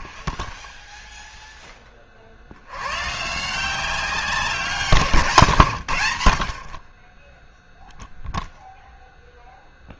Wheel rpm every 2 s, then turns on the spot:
10, 110, 180, 40, 0.
none